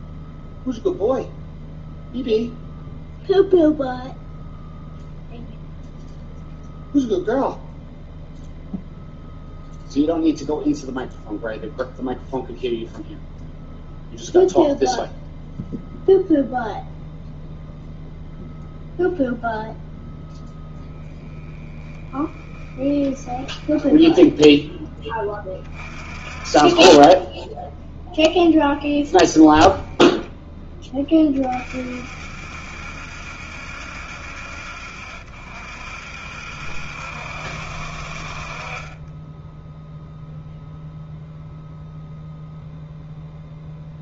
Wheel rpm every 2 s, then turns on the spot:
0, 0, 0, 0, 0, 0, 0, 0, 0, 0, 0, 10, 10, 20, 0, 10, 70, 70, 70, 30, 0, 0.
22-24